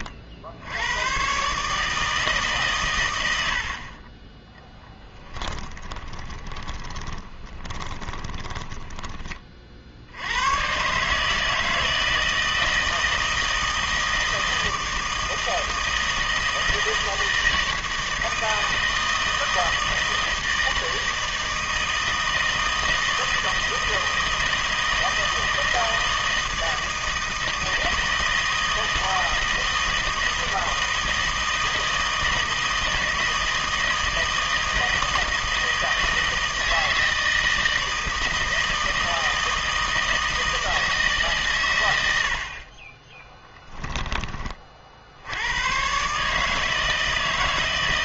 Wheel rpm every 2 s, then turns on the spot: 70, 140, 10, 20, 10, 110, 160, 160, 160, 160, 160, 160, 160, 160, 160, 160, 160, 160, 160, 160, 160, 40, 30, 160.
4-10